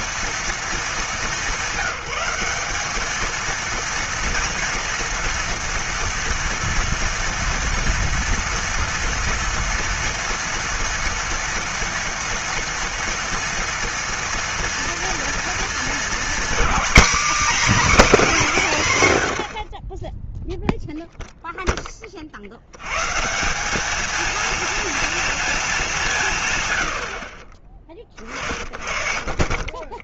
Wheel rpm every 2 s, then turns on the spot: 230, 200, 230, 230, 230, 240, 240, 230, 250, 220, 0, 70, 230, 140, 40.
none